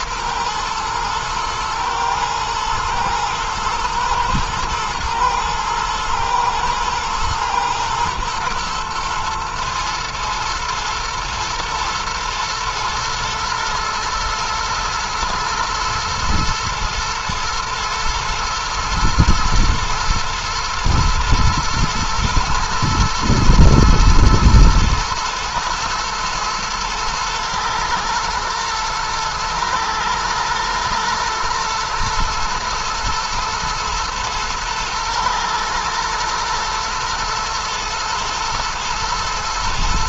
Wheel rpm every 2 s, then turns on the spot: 110, 120, 110, 110, 110, 120, 120, 110, 110, 110, 110, 110, 110, 120, 120, 110, 110, 120, 120, 110.
none